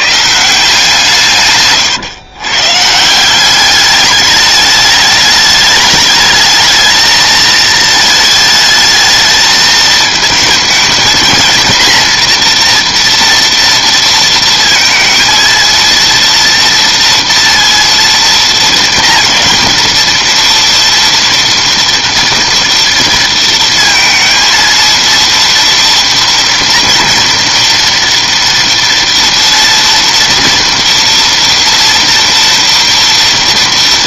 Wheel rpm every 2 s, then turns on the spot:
170, 150, 210, 220, 220, 220, 240, 230, 230, 230, 230, 230, 230, 230, 230, 240, 230.
none